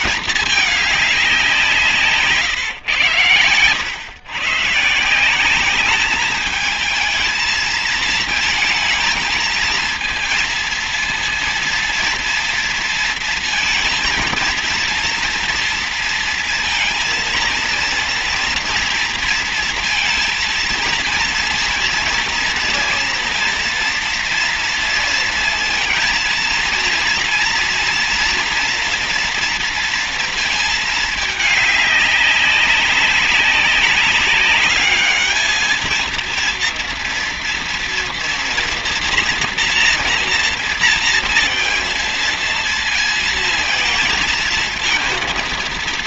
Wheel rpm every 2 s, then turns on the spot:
210, 140, 140, 210, 230, 230, 230, 230, 230, 230, 230, 230, 230, 230, 230, 220, 190, 210, 230, 230, 230, 230, 220.
none